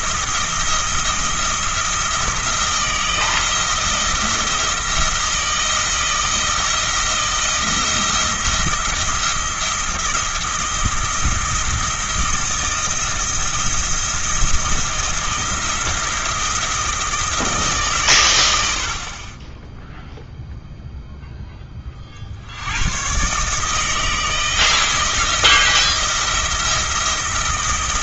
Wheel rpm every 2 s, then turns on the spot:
170, 160, 170, 160, 170, 170, 170, 170, 170, 60, 0, 100, 160, 170.
none